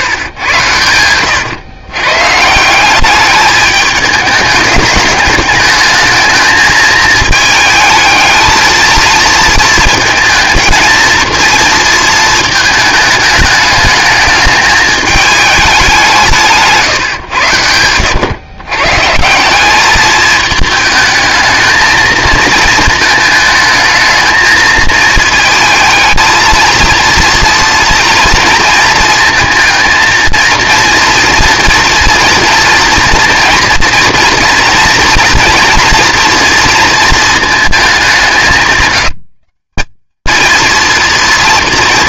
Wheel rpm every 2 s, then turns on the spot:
110, 160, 210, 220, 220, 230, 220, 210, 150, 130, 220, 230, 220, 220, 230, 230, 230, 240, 230, 170, 230.
none